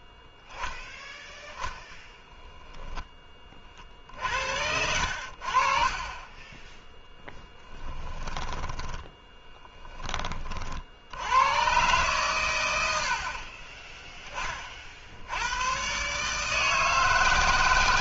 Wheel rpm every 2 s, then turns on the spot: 0, 10, 70, 10, 20, 40, 120, 20, 160.
6-10